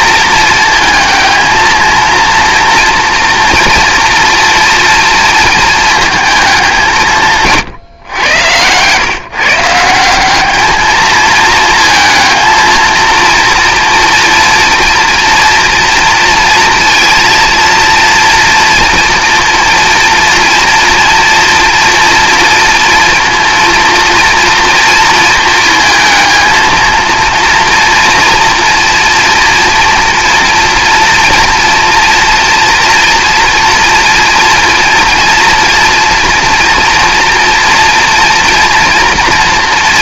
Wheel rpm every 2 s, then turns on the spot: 220, 230, 230, 190, 110, 210, 230, 230, 230, 230, 230, 230, 230, 230, 230, 230, 230, 230, 230, 230.
none